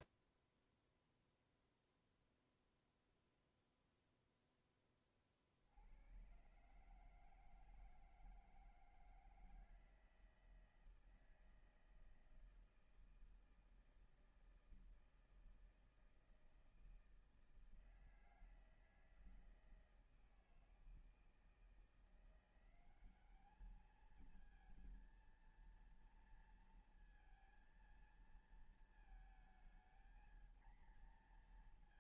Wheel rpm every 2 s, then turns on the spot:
0, 0, 0, 110, 160, 160, 160, 160, 160, 160, 160, 170, 220, 230, 230, 230.
none